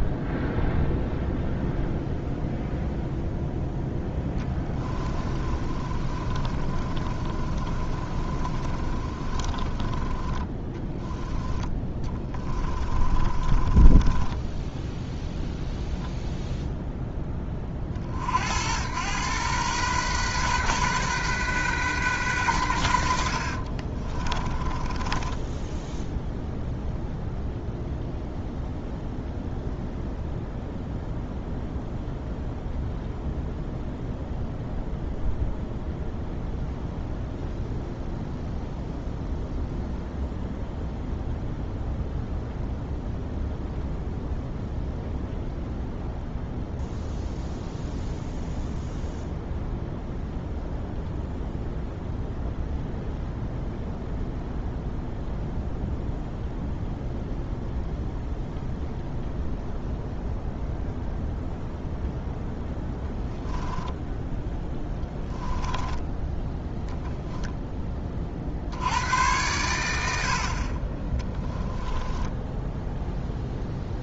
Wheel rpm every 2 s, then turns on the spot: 0, 0, 20, 30, 30, 10, 20, 10, 0, 90, 130, 80, 20, 0, 0, 0, 0, 0, 0, 0, 0, 0, 0, 0, 0, 0, 0, 0, 0, 0, 0, 10, 10, 0, 80, 30, 0.
4-16 24-26 64-66